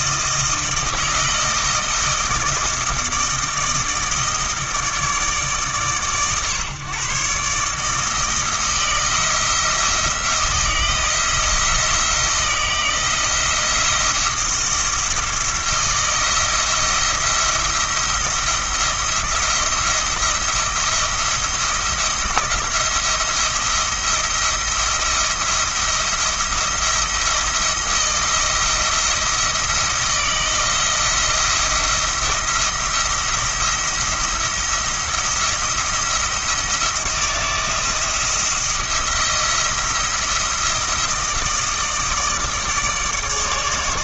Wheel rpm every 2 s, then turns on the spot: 160, 160, 160, 140, 160, 160, 160, 160, 170, 170, 170, 170, 170, 170, 170, 170, 170, 170, 160, 170, 170, 160.
none